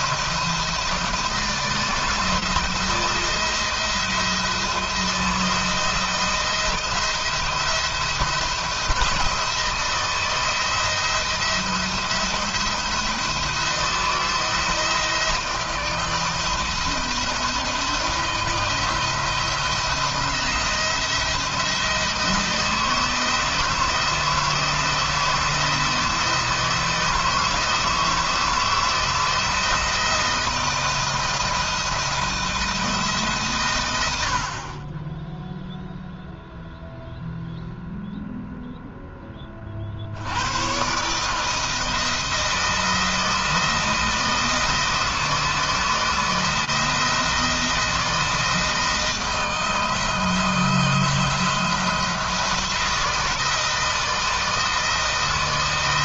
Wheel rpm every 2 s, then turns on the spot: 160, 160, 160, 160, 170, 170, 170, 160, 160, 170, 170, 160, 160, 160, 160, 160, 160, 20, 0, 10, 130, 170, 160, 170, 160, 160, 160, 160.
none